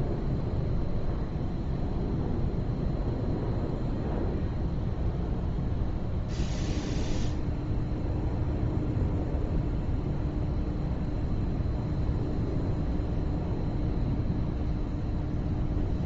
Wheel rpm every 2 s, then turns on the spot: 0, 0, 0, 0, 0, 0, 0, 0.
none